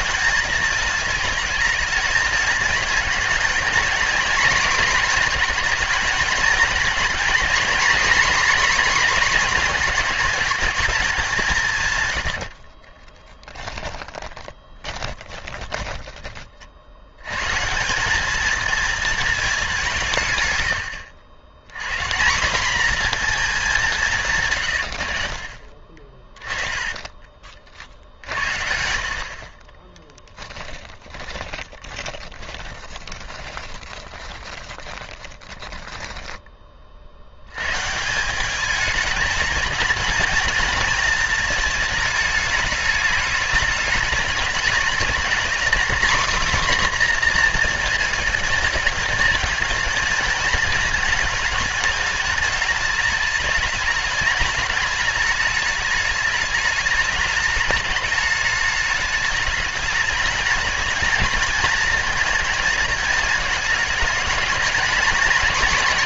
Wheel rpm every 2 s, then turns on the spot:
220, 220, 240, 230, 250, 220, 60, 30, 50, 220, 100, 210, 120, 20, 80, 20, 20, 20, 20, 200, 230, 210, 210, 260, 230, 220, 220, 210, 210, 210, 220, 220, 210.
12-16 26-28 30-36